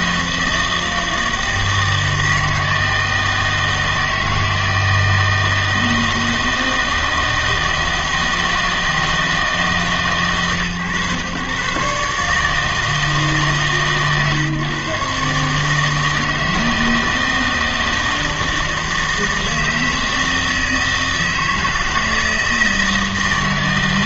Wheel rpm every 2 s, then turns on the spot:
160, 160, 160, 160, 160, 130, 150, 140, 160, 160, 160, 160.
none